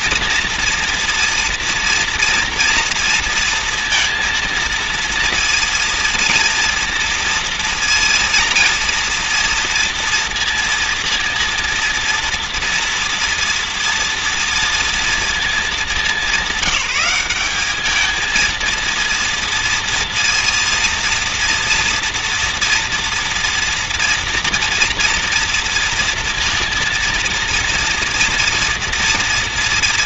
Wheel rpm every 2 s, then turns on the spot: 230, 230, 230, 230, 230, 230, 230, 230, 200, 230, 230, 240, 230, 230, 230.
none